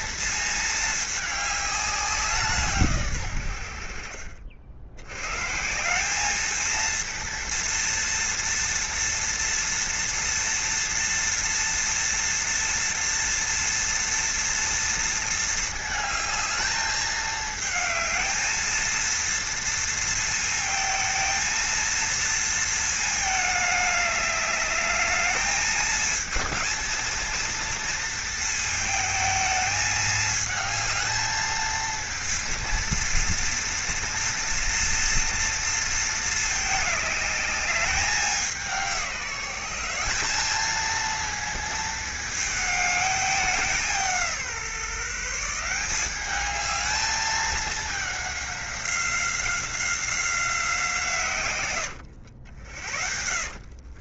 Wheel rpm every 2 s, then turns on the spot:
220, 140, 100, 230, 230, 230, 230, 230, 220, 230, 220, 220, 210, 230, 220, 220, 230, 230, 210, 180, 220, 210, 160, 210, 190, 160, 50.
52-54